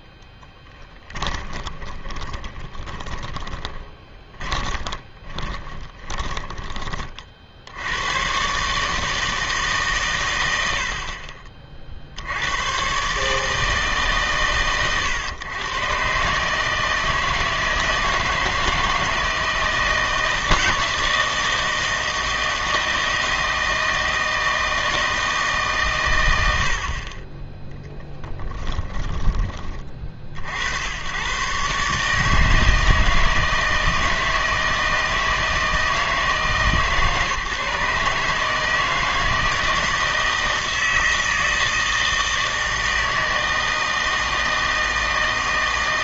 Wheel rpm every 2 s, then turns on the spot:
20, 20, 20, 20, 140, 80, 110, 130, 150, 160, 160, 160, 160, 80, 20, 80, 160, 160, 150, 160, 160, 160, 160.
0-6 28-30